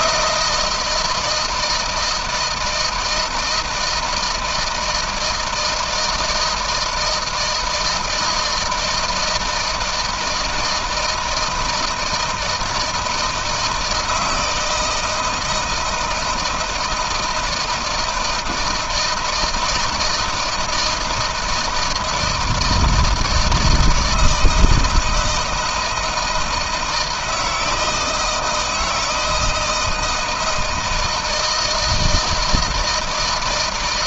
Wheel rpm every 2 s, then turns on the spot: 170, 160, 160, 160, 160, 160, 160, 160, 160, 160, 160, 160, 160, 160, 160, 160, 160.
none